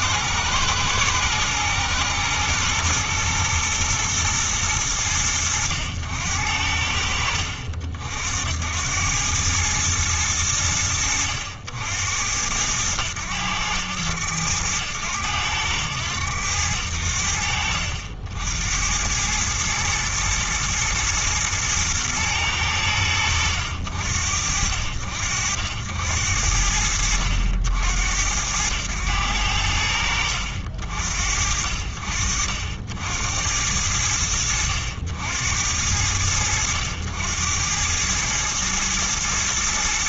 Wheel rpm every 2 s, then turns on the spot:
120, 120, 100, 60, 100, 80, 100, 100, 80, 100, 110, 90, 60, 70, 90, 70, 60, 70, 80, 110.
none